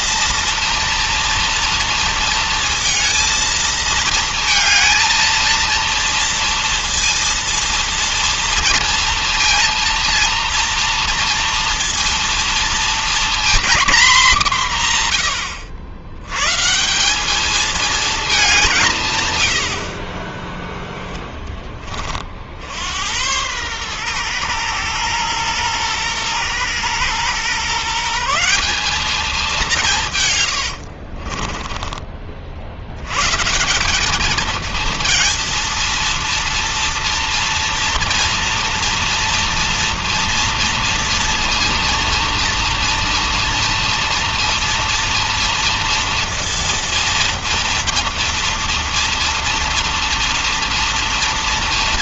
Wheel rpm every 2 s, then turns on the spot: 230, 230, 220, 230, 230, 230, 230, 200, 130, 200, 30, 60, 120, 120, 180, 110, 60, 220, 230, 230, 230, 230, 230, 230, 230, 240.
30-32